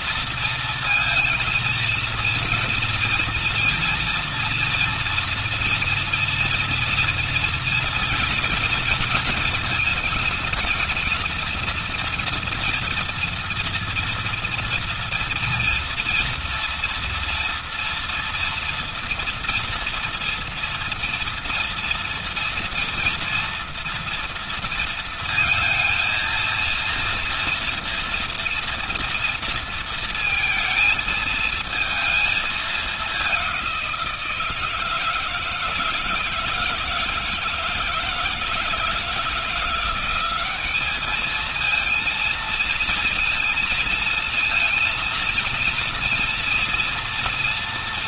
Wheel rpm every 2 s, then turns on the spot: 230, 230, 230, 240, 220, 220, 230, 230, 240, 240, 230, 230, 230, 230, 230, 230, 210, 160, 160, 170, 190, 230, 230, 240.
none